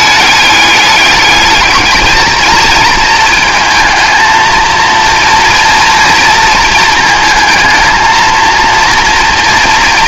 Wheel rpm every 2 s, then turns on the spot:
210, 230, 230, 230, 240.
none